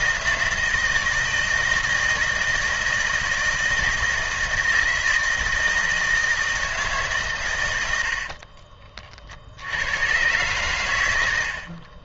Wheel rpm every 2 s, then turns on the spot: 160, 160, 160, 160, 40, 110.
8-10